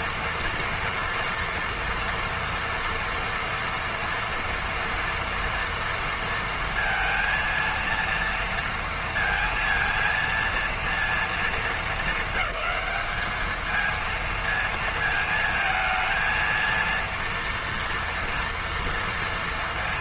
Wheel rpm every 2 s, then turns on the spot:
240, 230, 230, 230, 230, 230, 210, 220, 230, 230.
none